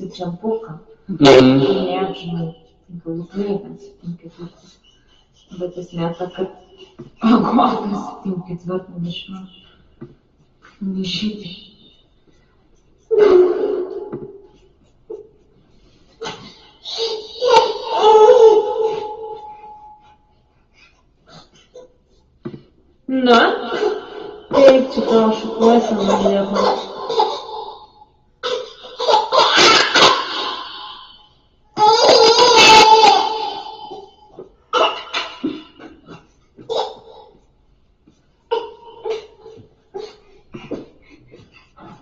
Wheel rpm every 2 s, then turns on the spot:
0, 0, 0, 0, 0, 0, 0, 0, 0, 0, 0, 0, 0, 0, 0, 0, 0, 0, 0, 0, 0.
none